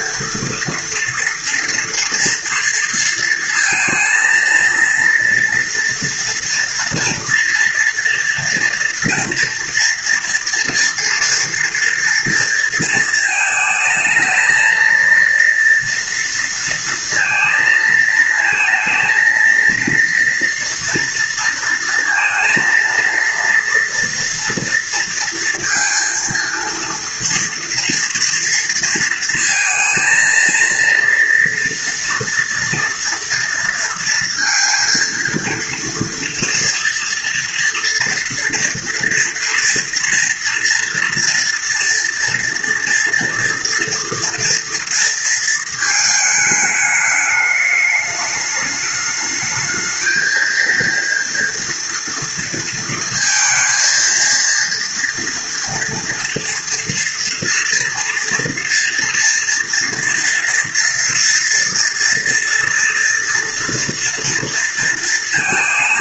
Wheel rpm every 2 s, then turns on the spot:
230, 230, 230, 240, 230, 230, 230, 230, 230, 230, 230, 230, 230, 230, 230, 230, 240, 230, 230, 230, 230, 230, 230, 210, 210, 230, 230, 230, 230, 230, 230, 230, 230.
none